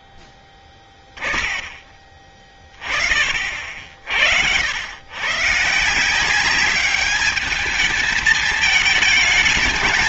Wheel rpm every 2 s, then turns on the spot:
20, 30, 100, 200, 220.
0-2